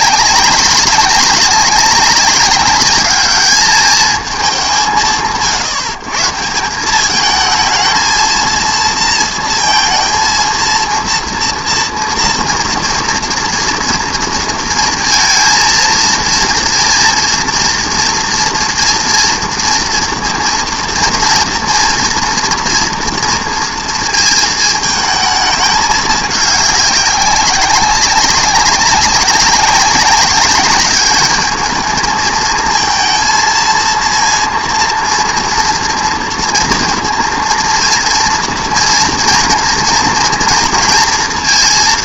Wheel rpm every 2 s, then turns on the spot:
200, 200, 190, 170, 230, 230, 240, 230, 230, 230, 230, 230, 220, 200, 190, 200, 230, 230, 230, 230, 230.
none